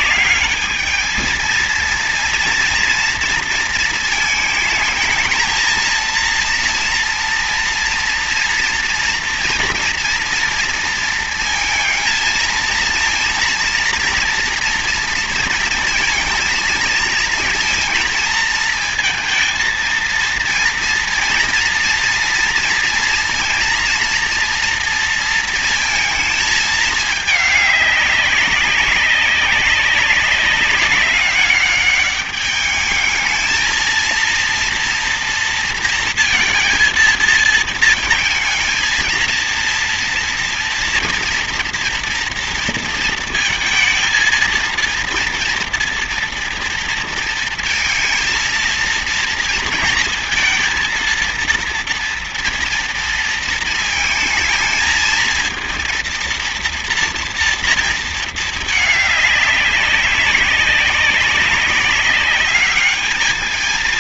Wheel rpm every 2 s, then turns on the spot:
220, 230, 220, 230, 230, 230, 230, 230, 230, 220, 230, 230, 230, 210, 200, 200, 210, 230, 230, 230, 230, 230, 230, 230, 230, 230, 230, 220, 230, 210, 200, 210.
none